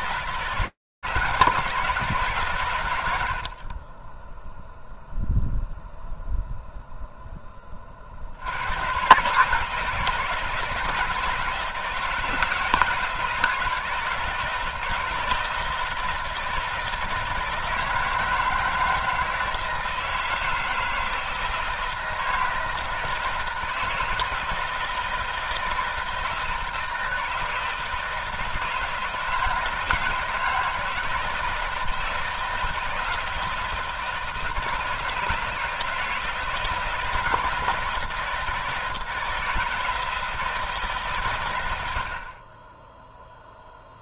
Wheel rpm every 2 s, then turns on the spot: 160, 150, 0, 0, 80, 160, 170, 170, 160, 160, 160, 160, 160, 160, 160, 160, 160, 160, 160, 160, 160, 70.
none